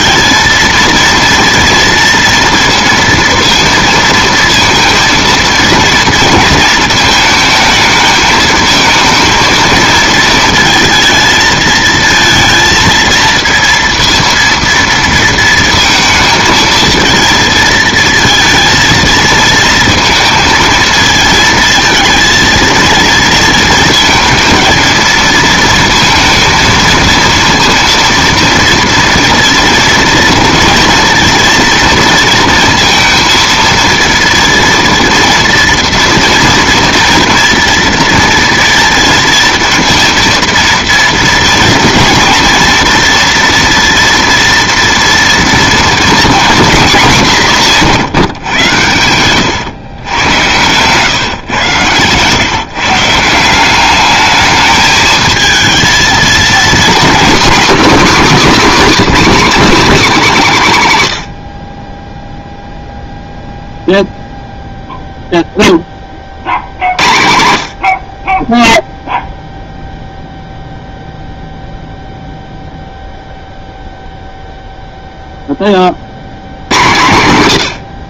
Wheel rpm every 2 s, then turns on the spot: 220, 230, 230, 220, 220, 220, 230, 230, 230, 220, 230, 230, 230, 230, 230, 230, 230, 230, 230, 230, 230, 230, 230, 200, 110, 140, 160, 220, 260, 260, 160, 0, 0, 70, 0, 0, 0, 0, 140.
48-50